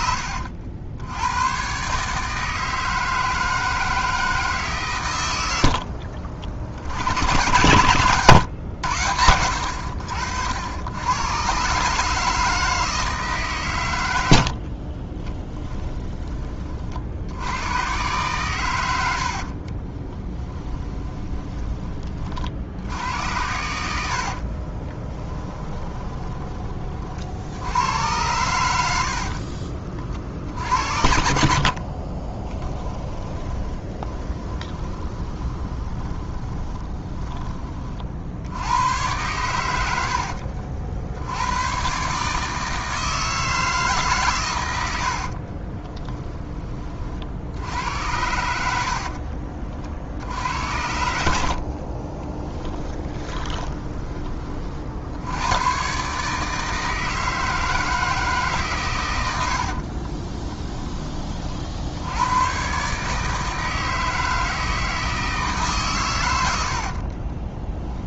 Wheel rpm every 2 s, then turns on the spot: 80, 160, 140, 70, 100, 80, 160, 50, 40, 100, 20, 70, 30, 40, 90, 60, 20, 20, 20, 90, 70, 160, 90, 40, 70, 80, 10, 50, 160, 130, 10, 130, 160, 70.
14-16 20-22 24-26 32-38 52-54 66-68